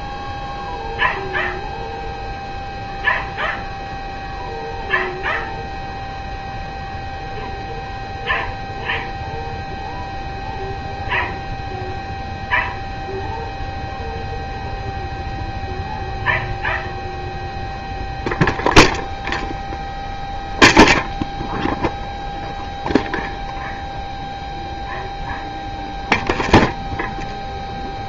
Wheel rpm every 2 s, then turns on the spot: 0, 0, 0, 0, 0, 0, 0, 0, 0, 0, 0, 0, 0, 0.
none